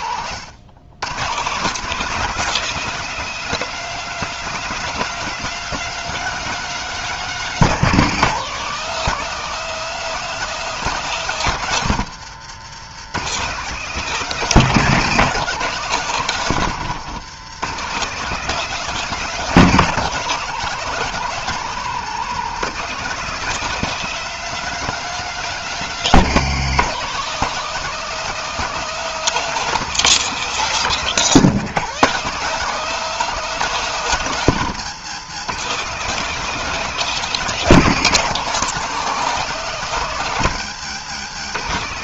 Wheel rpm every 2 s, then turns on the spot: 120, 210, 210, 200, 200, 190, 170, 190, 170, 200, 200, 200, 200, 180, 200, 200, 200, 170, 200, 200, 160.
none